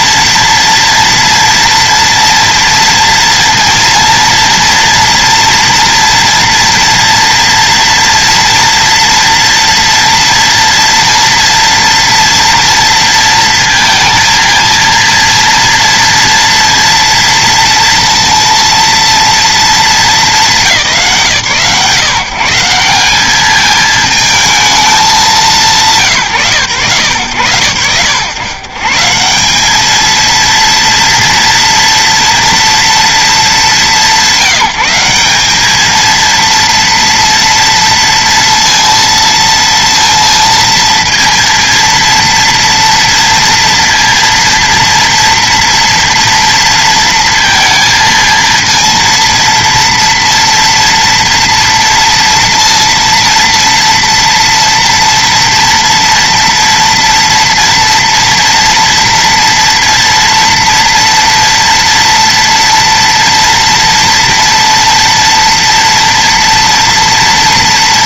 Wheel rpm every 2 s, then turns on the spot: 230, 230, 230, 230, 230, 230, 230, 230, 230, 230, 180, 170, 220, 110, 120, 230, 230, 180, 230, 230, 230, 230, 230, 230, 230, 230, 230, 230, 230, 230, 230, 230, 230, 230.
none